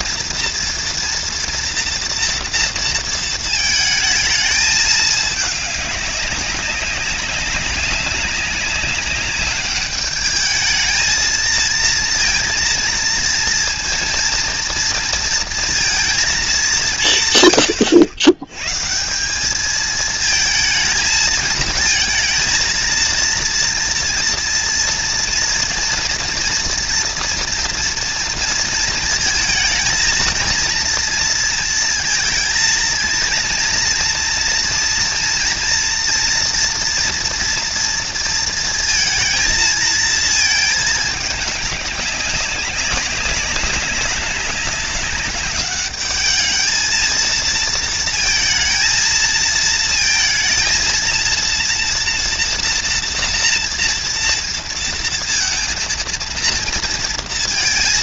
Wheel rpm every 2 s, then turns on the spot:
230, 220, 200, 190, 210, 230, 230, 230, 110, 220, 220, 230, 230, 230, 230, 230, 230, 230, 230, 230, 210, 200, 200, 230, 230, 230, 230, 230, 230.
none